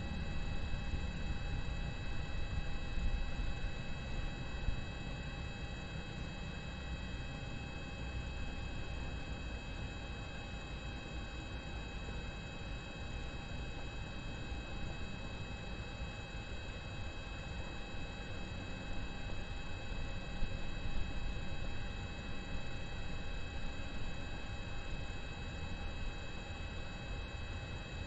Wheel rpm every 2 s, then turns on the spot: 0, 0, 0, 0, 0, 0, 0, 0, 0, 0, 0, 0, 0, 0.
none